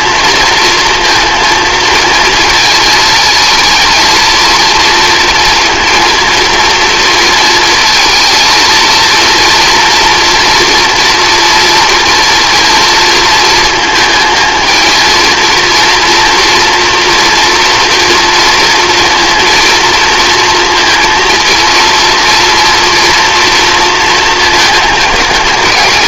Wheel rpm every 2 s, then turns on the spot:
230, 220, 230, 230, 220, 230, 230, 220, 230, 230, 230, 240, 220.
none